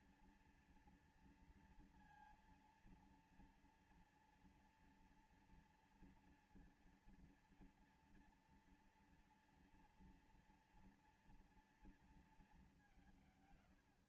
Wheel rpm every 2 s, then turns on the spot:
230, 230, 230, 230, 240, 230, 190.
none